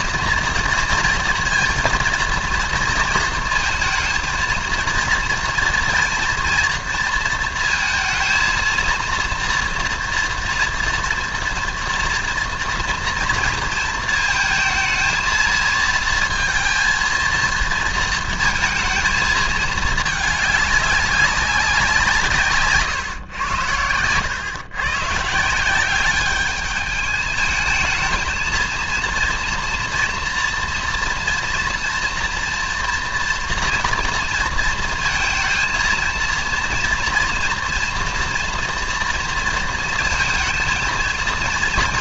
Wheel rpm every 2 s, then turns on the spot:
230, 230, 230, 230, 230, 230, 230, 220, 230, 230, 200, 130, 120, 210, 230, 230, 230, 230, 230, 230, 230.
none